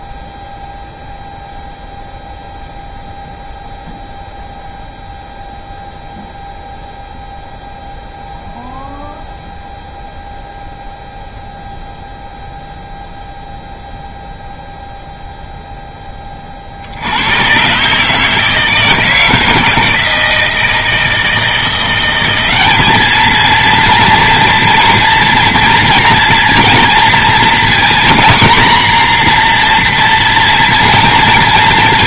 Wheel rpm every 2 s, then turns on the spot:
0, 0, 0, 0, 0, 0, 0, 0, 40, 160, 160, 200, 230, 230, 240, 230.
none